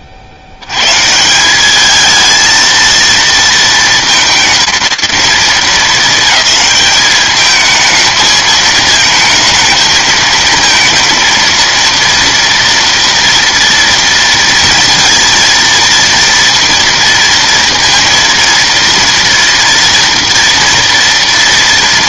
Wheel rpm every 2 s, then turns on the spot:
50, 220, 220, 220, 220, 230, 230, 230, 230, 230, 230.
none